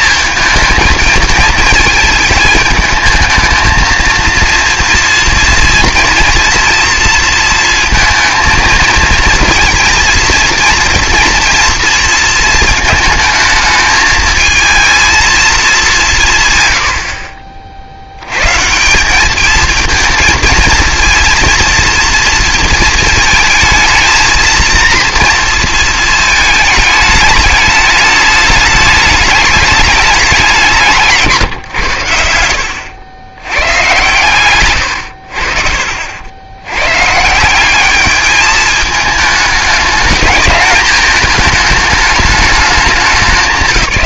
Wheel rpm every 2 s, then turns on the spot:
220, 220, 230, 230, 230, 230, 220, 220, 120, 150, 230, 220, 230, 220, 210, 180, 80, 100, 120, 210, 210, 200.
32-36